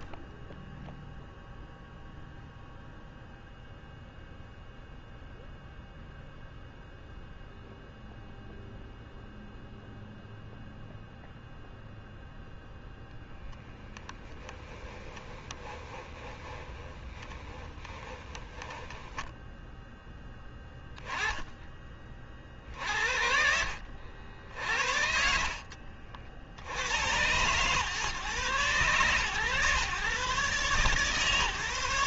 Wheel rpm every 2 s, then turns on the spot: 0, 0, 0, 0, 0, 0, 0, 10, 20, 10, 10, 50, 70, 70, 130, 140.
14-20